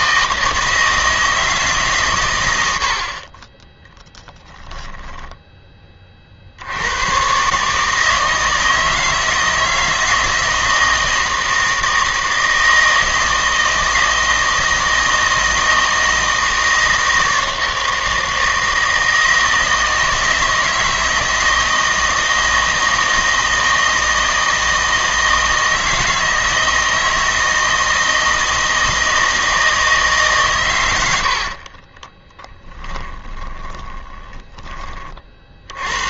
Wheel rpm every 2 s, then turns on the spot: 160, 80, 10, 80, 160, 160, 160, 160, 160, 160, 160, 160, 160, 160, 160, 120, 10, 20.
4-6 32-34